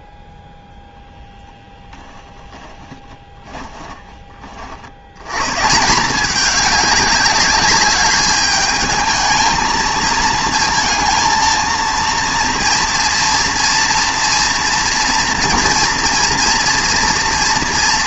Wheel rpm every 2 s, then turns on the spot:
0, 30, 70, 210, 220, 230, 230, 240, 240.
2-4